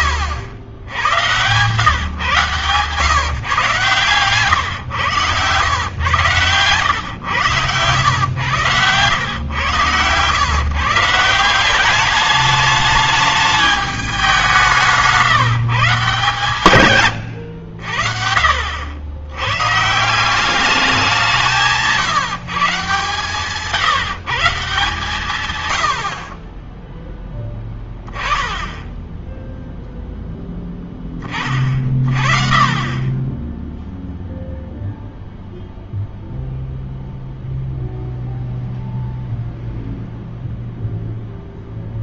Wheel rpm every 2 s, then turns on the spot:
80, 130, 130, 120, 100, 130, 210, 180, 150, 60, 180, 160, 160, 30, 10, 0, 40, 0, 0, 0, 0.
none